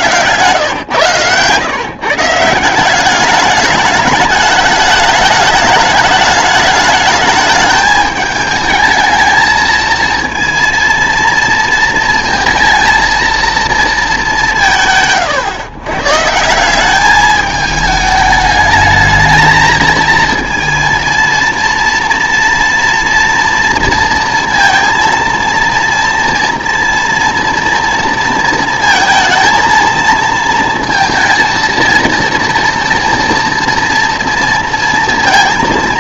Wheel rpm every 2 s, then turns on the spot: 130, 180, 210, 210, 210, 230, 230, 170, 190, 220, 230, 230, 230, 230, 230, 230, 230, 230.
none